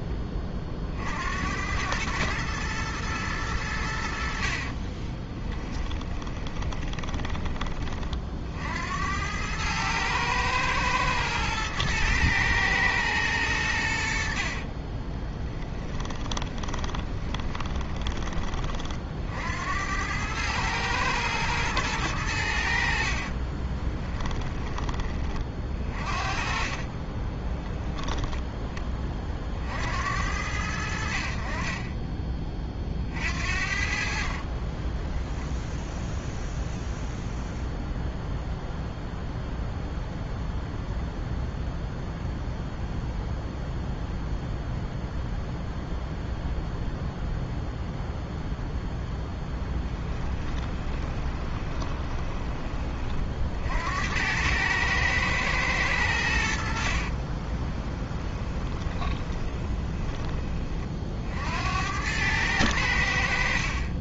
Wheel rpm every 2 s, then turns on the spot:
30, 110, 40, 20, 60, 110, 110, 60, 20, 30, 110, 80, 10, 30, 10, 80, 30, 20, 0, 0, 0, 0, 0, 0, 0, 20, 20, 100, 70, 20, 20, 100.
4-8 14-18 26-28 34-36 50-52 58-60